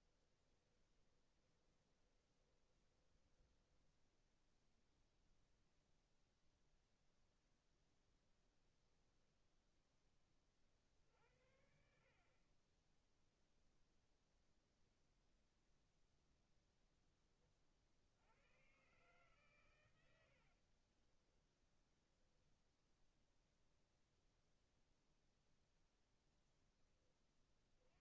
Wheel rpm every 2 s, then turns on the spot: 20, 20, 0, 0, 0, 50, 20, 0, 10, 130, 40, 0, 0, 10.
0-4 20-22